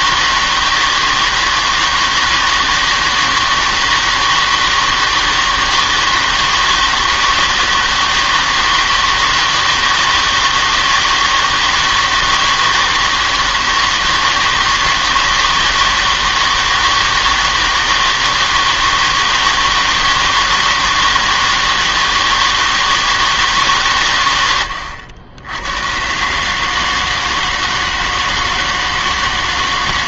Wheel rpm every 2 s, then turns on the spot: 160, 160, 160, 160, 160, 160, 160, 160, 160, 160, 160, 160, 100, 150, 160.
none